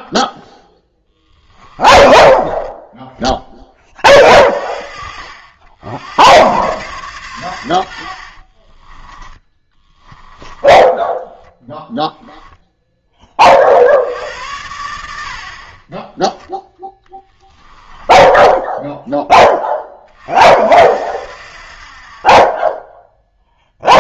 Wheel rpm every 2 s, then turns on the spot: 0, 10, 60, 120, 30, 10, 10, 80, 10, 10, 60, 10.
2-4 8-12 16-20